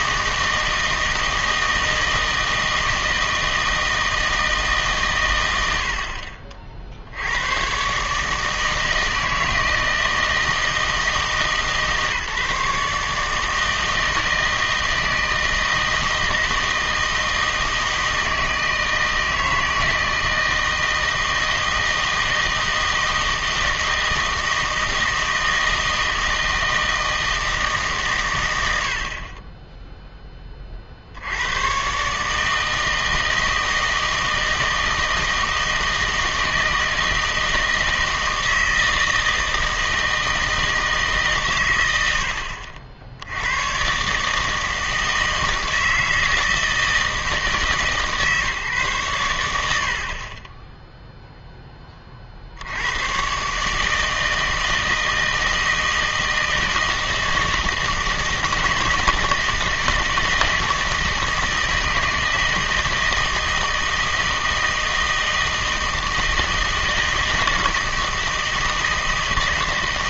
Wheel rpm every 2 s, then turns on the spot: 160, 160, 140, 60, 160, 160, 150, 160, 160, 160, 160, 160, 160, 160, 80, 40, 160, 160, 160, 160, 160, 70, 160, 160, 140, 10, 90, 160, 160, 160, 160, 160, 160, 160, 160.
none